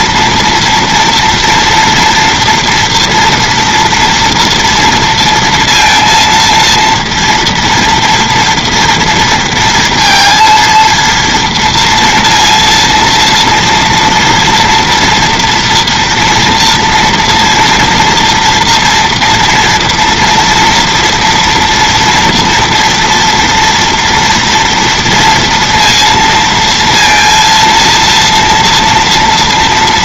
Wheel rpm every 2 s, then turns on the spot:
230, 240, 230, 230, 230, 230, 230, 230, 230, 240, 240, 230, 230, 230, 230.
none